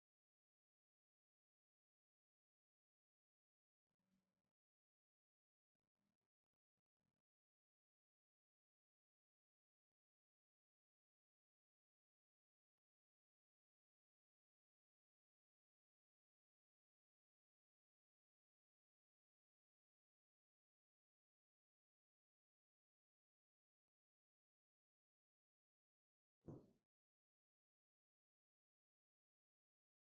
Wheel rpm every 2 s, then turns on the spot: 0, 0, 0, 0, 0, 0, 0, 0, 0, 0, 0, 0, 0, 0, 0.
none